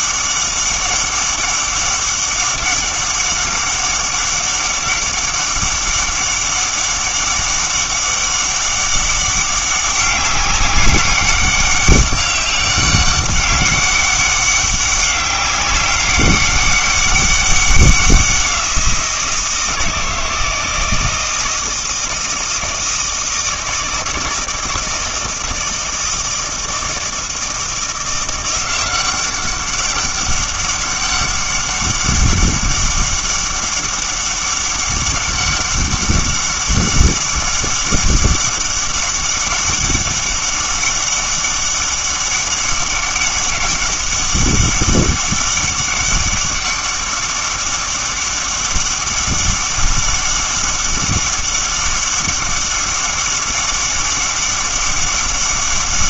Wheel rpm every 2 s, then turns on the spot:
200, 200, 200, 200, 200, 200, 200, 200, 200, 180, 160, 160, 160, 160, 180, 200, 200, 200, 200, 200, 200, 200, 200, 200, 200, 200, 200, 200.
none